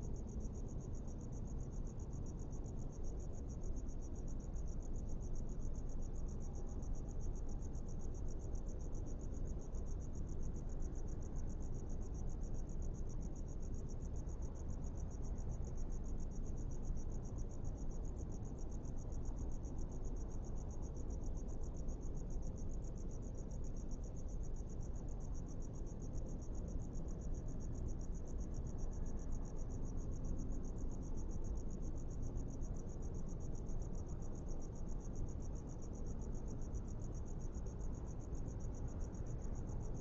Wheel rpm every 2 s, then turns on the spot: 0, 0, 0, 0, 0, 0, 0, 0, 0, 0, 0, 0, 0, 0, 0, 0, 0, 0, 0, 0.
none